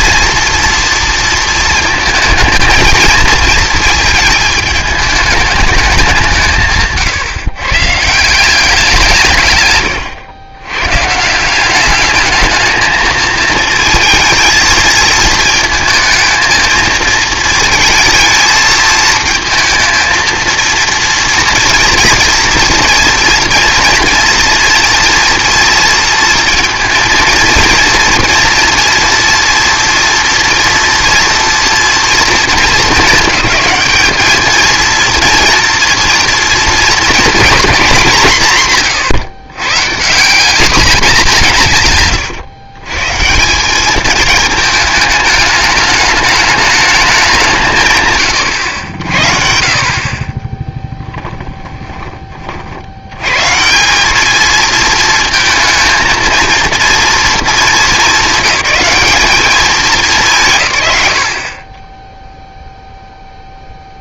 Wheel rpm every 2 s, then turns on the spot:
230, 220, 220, 150, 180, 110, 220, 220, 220, 220, 230, 230, 230, 230, 230, 230, 220, 230, 230, 140, 210, 140, 220, 210, 100, 10, 60, 220, 230, 200, 140, 0.
none